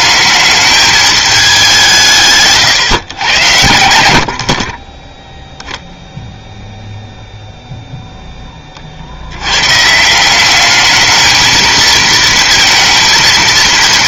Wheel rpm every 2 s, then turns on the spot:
210, 140, 30, 0, 30, 200, 230.
4-6